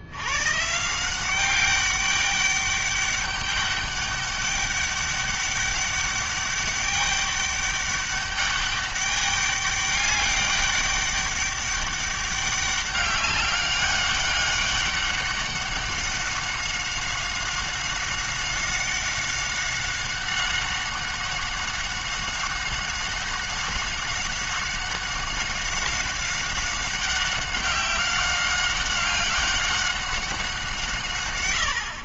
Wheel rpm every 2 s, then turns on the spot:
160, 200, 200, 200, 200, 200, 200, 190, 190, 190, 190, 190, 190, 190, 200, 150.
none